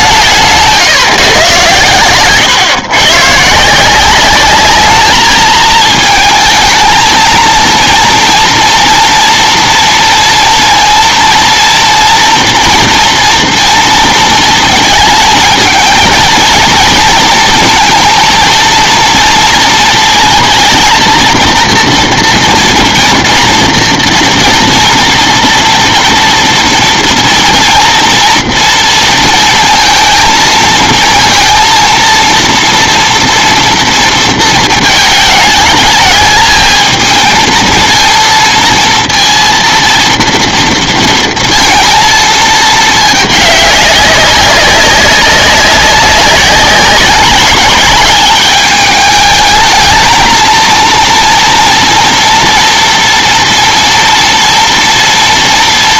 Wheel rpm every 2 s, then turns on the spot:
150, 130, 210, 220, 230, 230, 230, 230, 230, 230, 230, 230, 230, 230, 230, 230, 230, 220, 220, 230, 220, 220, 190, 190, 210, 230, 230, 230.
0-2